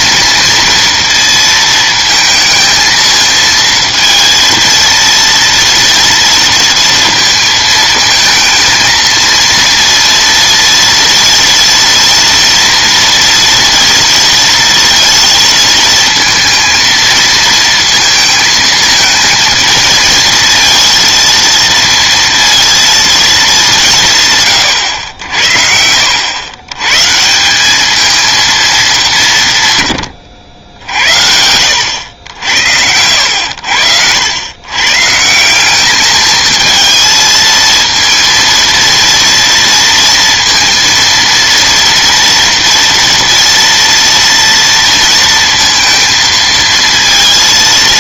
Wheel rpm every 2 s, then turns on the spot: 230, 220, 230, 230, 220, 230, 230, 230, 230, 220, 230, 230, 130, 120, 210, 70, 70, 120, 220, 230, 230, 230, 230, 230.
none